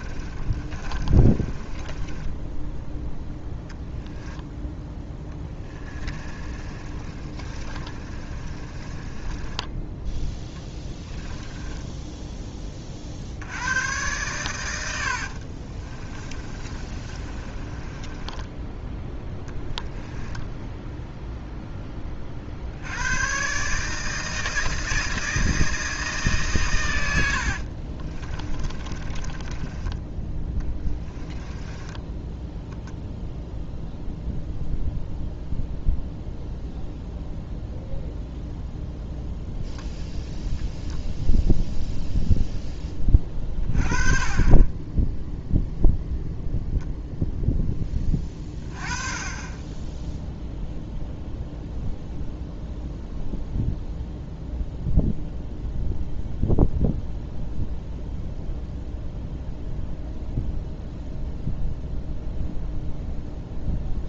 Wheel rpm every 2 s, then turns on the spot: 30, 10, 10, 30, 30, 10, 30, 90, 30, 10, 10, 60, 160, 130, 30, 20, 0, 0, 0, 0, 0, 10, 20, 0, 20, 0, 0, 0, 0, 0, 0, 0.
0-4 6-12 16-22 28-32